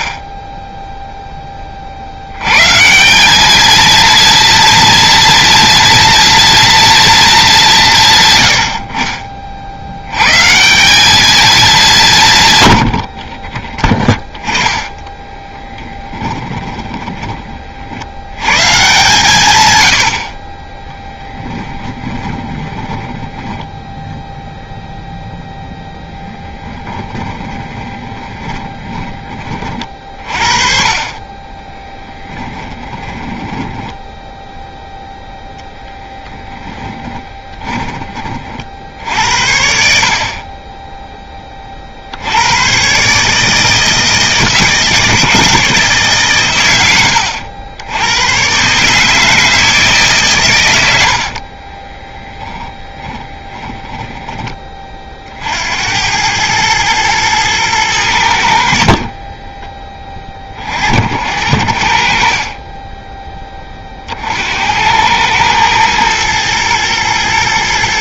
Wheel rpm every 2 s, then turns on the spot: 0, 150, 230, 230, 60, 190, 70, 10, 20, 130, 10, 10, 0, 10, 20, 40, 20, 0, 20, 60, 20, 120, 160, 110, 140, 100, 10, 30, 110, 40, 60, 20, 90, 120.
14-18 20-24 26-30 32-34 36-38 52-54 62-64